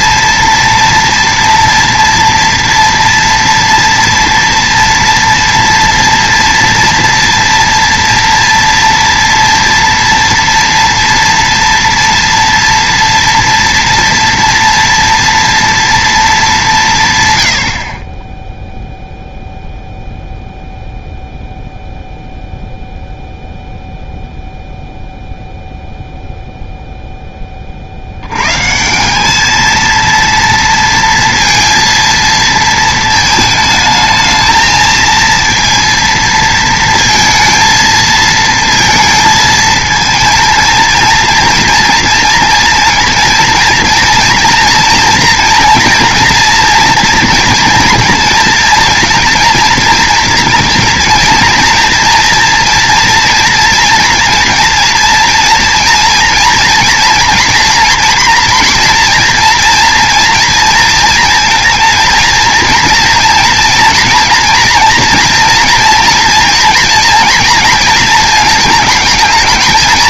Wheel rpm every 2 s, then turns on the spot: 230, 230, 230, 230, 230, 230, 230, 230, 190, 0, 0, 0, 0, 0, 140, 230, 220, 220, 230, 230, 230, 230, 230, 230, 230, 230, 230, 230, 230, 230, 230, 230, 230, 230, 220.
none